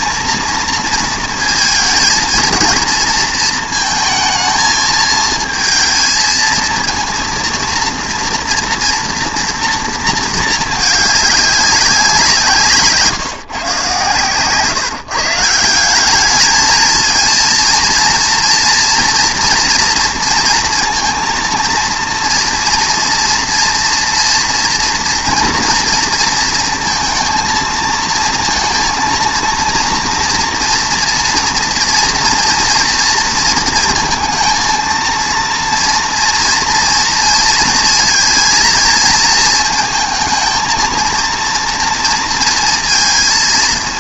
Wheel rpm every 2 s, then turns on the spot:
230, 230, 220, 230, 240, 210, 150, 150, 230, 230, 230, 230, 240, 230, 230, 240, 230, 230, 230, 220, 230, 230.
none